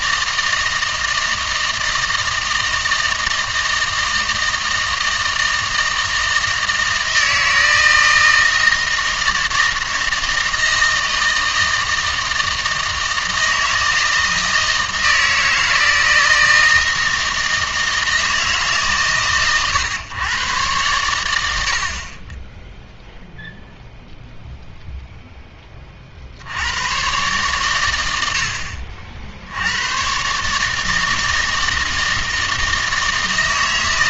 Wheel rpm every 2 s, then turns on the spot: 160, 160, 160, 160, 160, 160, 160, 160, 160, 150, 110, 0, 0, 100, 50, 150, 160.
none